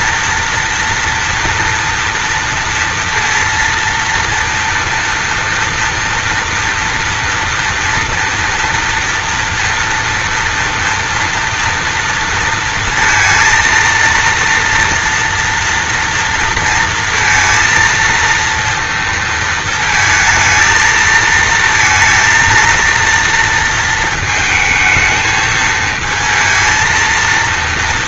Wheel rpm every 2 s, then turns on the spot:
230, 230, 230, 230, 230, 230, 230, 230, 230, 230, 230, 230, 220, 230.
none